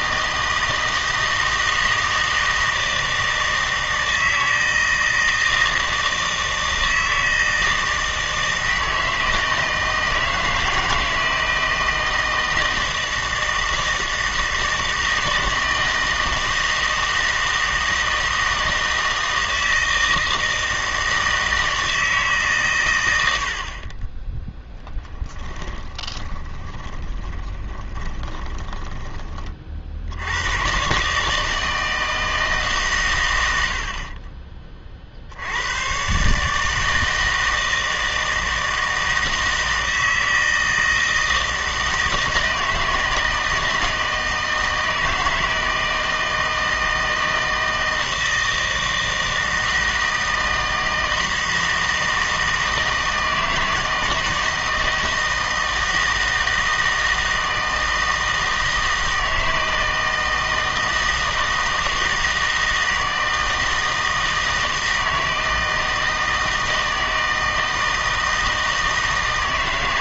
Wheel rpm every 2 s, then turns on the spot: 160, 160, 160, 160, 160, 160, 160, 160, 160, 160, 160, 130, 10, 20, 20, 120, 150, 40, 150, 160, 160, 160, 160, 160, 160, 160, 160, 160, 160, 160, 160, 160, 160, 160, 160.
26-30